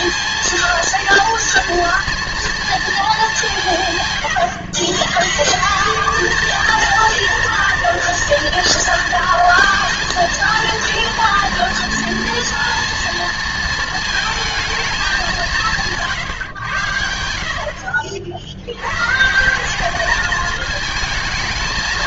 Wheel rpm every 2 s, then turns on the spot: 230, 110, 220, 230, 230, 230, 220, 130, 70, 220, 230.
none